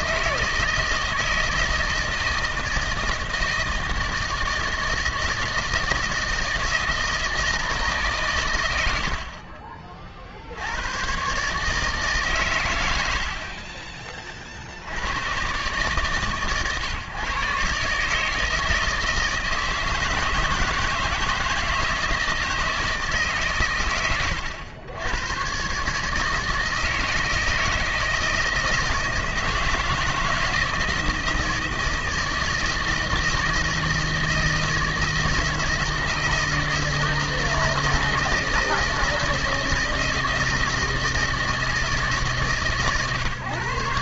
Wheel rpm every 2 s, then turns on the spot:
160, 160, 160, 160, 110, 70, 130, 30, 130, 150, 160, 160, 100, 160, 160, 160, 160, 160, 160, 160, 160, 150.
none